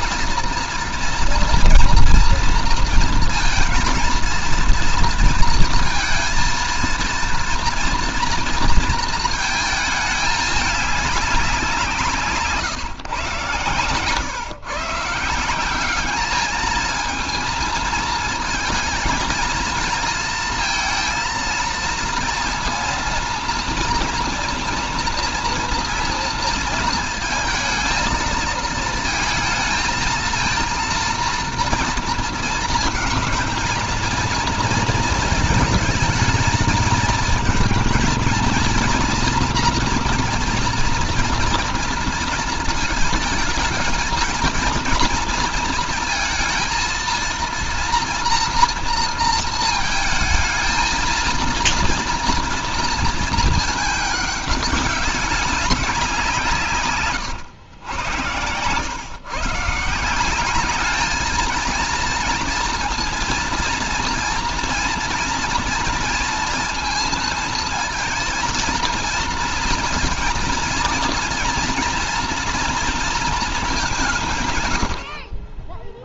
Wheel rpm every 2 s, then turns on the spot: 230, 230, 230, 230, 230, 210, 150, 130, 210, 220, 230, 230, 230, 230, 220, 230, 230, 230, 220, 230, 230, 220, 220, 230, 240, 220, 230, 210, 160, 100, 190, 230, 230, 230, 230, 230, 240, 140.
none